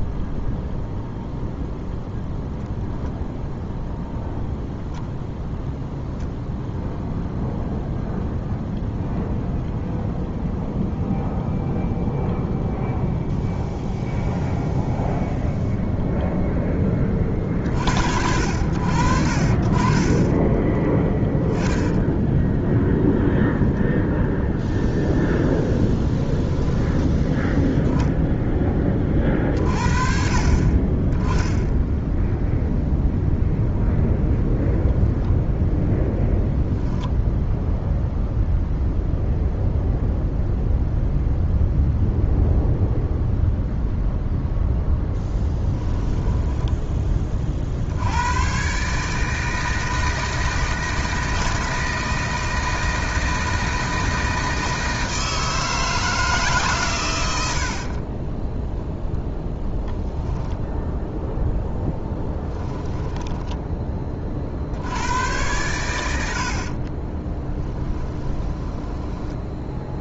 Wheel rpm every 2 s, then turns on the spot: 0, 0, 0, 0, 0, 0, 0, 0, 0, 70, 10, 0, 0, 10, 10, 30, 0, 10, 0, 0, 0, 0, 0, 10, 130, 160, 160, 160, 140, 10, 0, 10, 60, 40, 10.
20-22 26-28 46-48 62-64 68-70